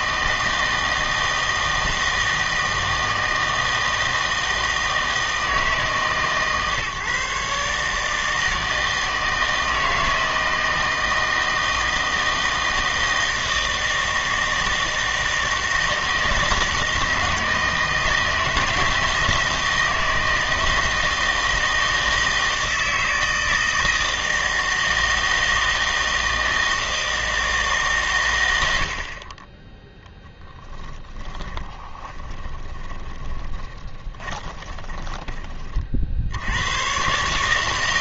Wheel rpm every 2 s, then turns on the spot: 160, 160, 160, 140, 160, 160, 160, 160, 160, 160, 160, 160, 160, 160, 90, 10, 10, 20, 90.
30-36